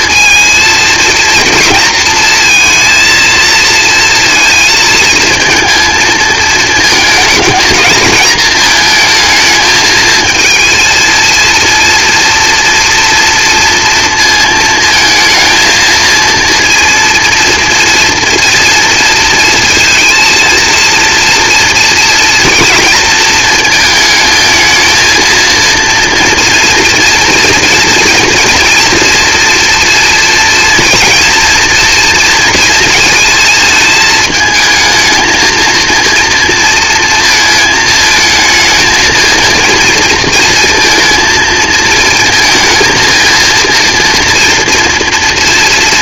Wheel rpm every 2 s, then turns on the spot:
230, 230, 220, 230, 220, 220, 240, 220, 230, 230, 230, 230, 220, 240, 240, 230, 230, 220, 230, 220, 230, 230, 240.
none